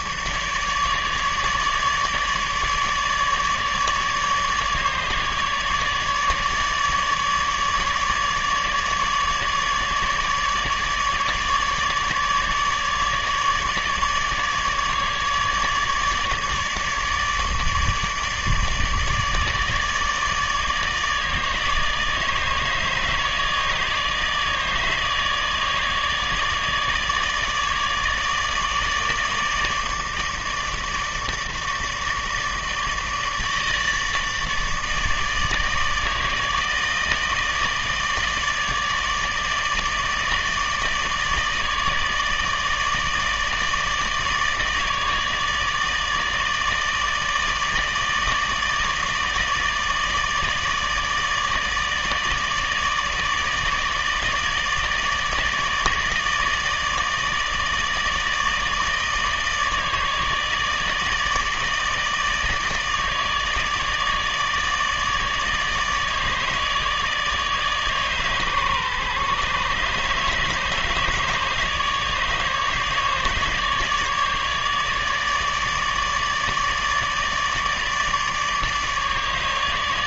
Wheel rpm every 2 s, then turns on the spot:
150, 150, 150, 150, 150, 150, 150, 150, 150, 150, 160, 150, 150, 150, 150, 150, 160, 150, 160, 150, 160, 160, 150, 150, 150, 150, 150, 160, 160, 150, 150, 150, 160, 160, 140, 150, 150, 150, 150, 150.
none